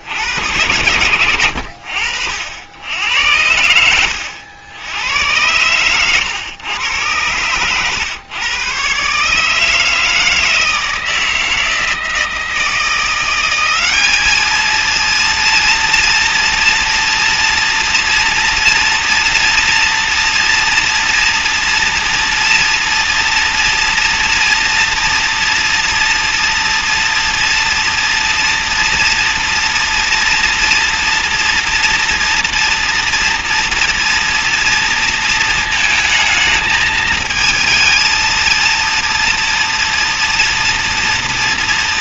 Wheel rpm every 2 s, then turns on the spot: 70, 90, 110, 120, 160, 160, 200, 230, 240, 230, 230, 230, 240, 230, 230, 240, 230, 220, 230, 240, 230.
2-4